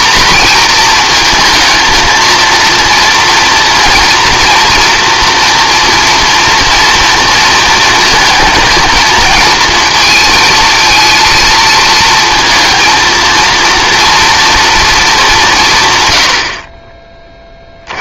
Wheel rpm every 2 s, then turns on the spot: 230, 230, 240, 230, 220, 220, 230, 210, 30.
none